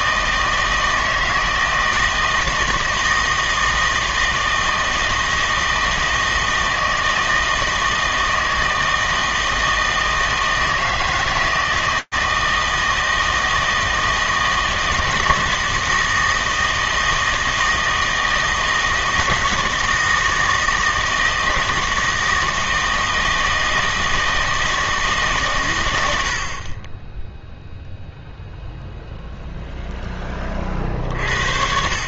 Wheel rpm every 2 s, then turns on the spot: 160, 160, 160, 160, 160, 160, 160, 160, 160, 160, 160, 160, 160, 30, 0, 40.
none